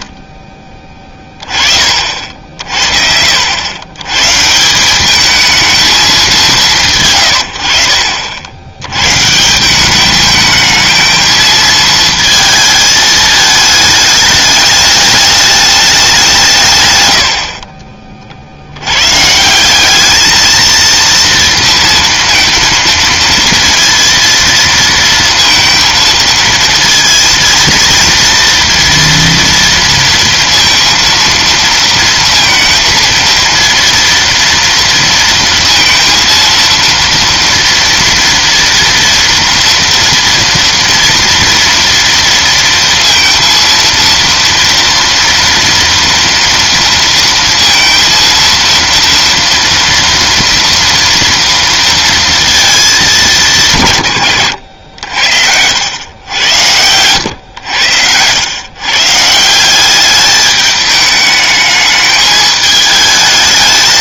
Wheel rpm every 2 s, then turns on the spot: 10, 60, 150, 180, 80, 220, 220, 210, 160, 80, 220, 230, 230, 230, 230, 230, 230, 230, 230, 230, 230, 230, 230, 230, 230, 230, 220, 90, 100, 130, 210, 210.
none